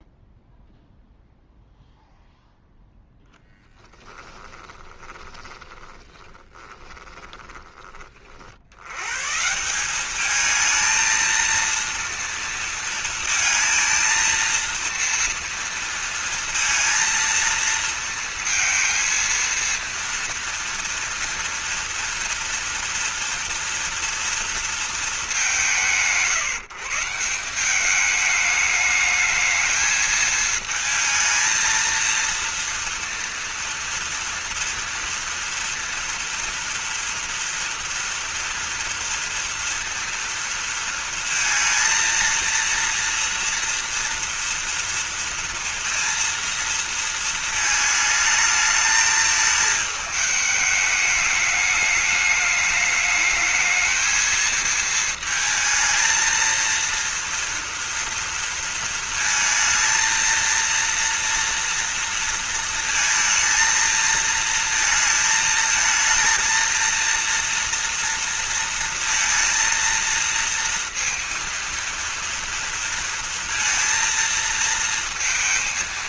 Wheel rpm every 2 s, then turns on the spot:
0, 0, 20, 30, 100, 220, 230, 230, 230, 230, 230, 230, 230, 160, 210, 220, 230, 230, 230, 230, 230, 230, 230, 230, 220, 210, 220, 230, 230, 230, 230, 230, 230, 230, 230, 230, 230, 230.
4-8